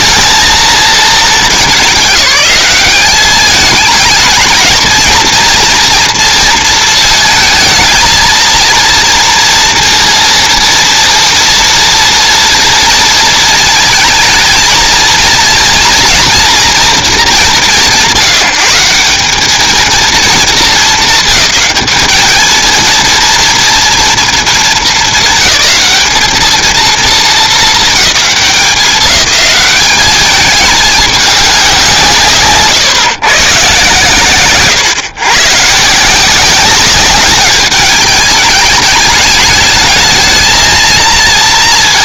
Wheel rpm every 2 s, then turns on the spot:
220, 210, 230, 220, 230, 230, 220, 230, 180, 210, 200, 230, 210, 220, 200, 210, 140, 120, 200, 210, 230.
none